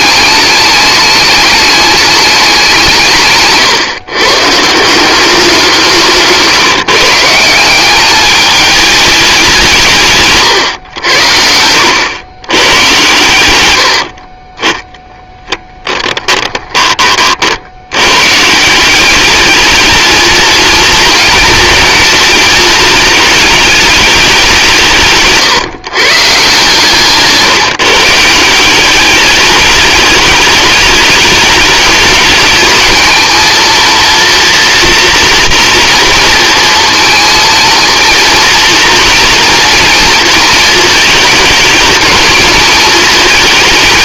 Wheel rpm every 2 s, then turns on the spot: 210, 170, 160, 160, 210, 110, 110, 30, 20, 180, 220, 220, 170, 150, 190, 210, 220, 230, 230, 230, 220, 220.
14-16